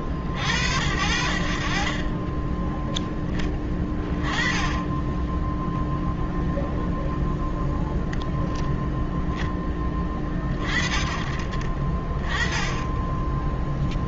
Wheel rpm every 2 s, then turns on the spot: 70, 10, 10, 0, 0, 30, 10.
4-6 12-14